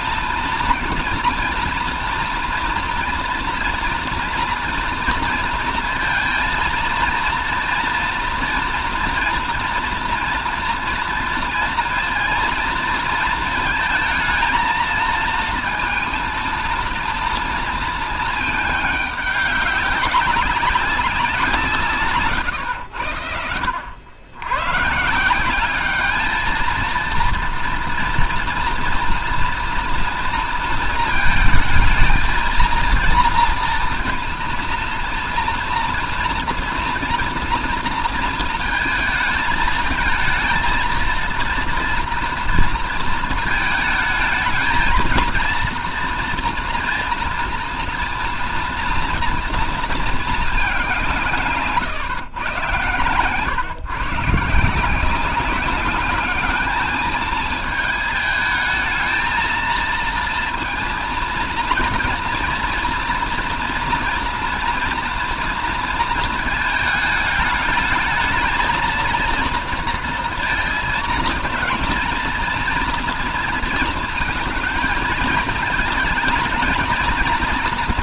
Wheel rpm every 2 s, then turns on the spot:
230, 230, 230, 230, 230, 230, 230, 230, 230, 220, 200, 100, 110, 220, 230, 230, 230, 230, 230, 230, 220, 230, 220, 240, 230, 210, 120, 160, 210, 220, 230, 240, 230, 220, 220, 230, 230, 230, 230.
none